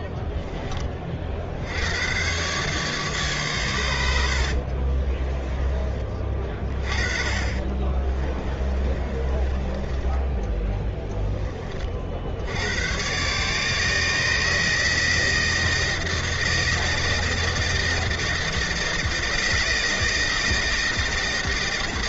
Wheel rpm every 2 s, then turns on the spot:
10, 140, 60, 30, 20, 10, 70, 160, 160, 160, 160.
4-6 8-12